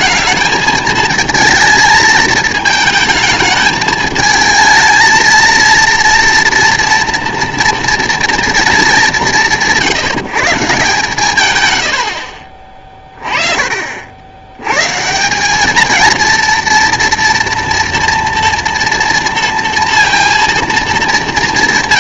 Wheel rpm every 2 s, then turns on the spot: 220, 220, 220, 230, 220, 150, 30, 120, 230, 230, 230.
none